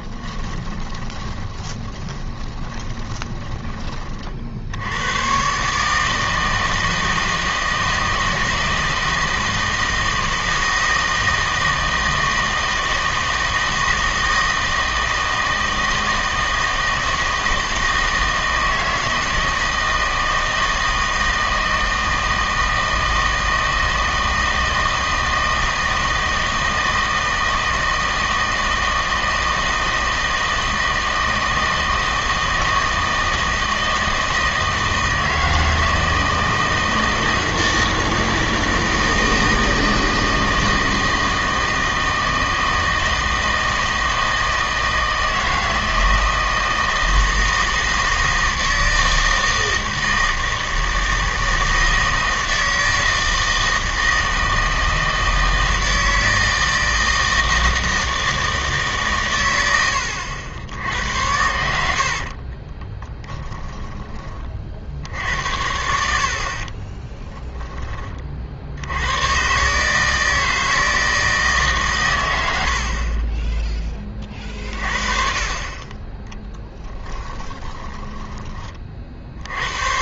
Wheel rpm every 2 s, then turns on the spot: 20, 20, 70, 160, 160, 160, 160, 160, 160, 160, 160, 160, 160, 160, 160, 160, 160, 160, 160, 160, 160, 160, 160, 160, 160, 160, 160, 160, 160, 150, 80, 30, 60, 30, 60, 160, 80, 40, 10, 30.
0-4 62-64 66-68 76-78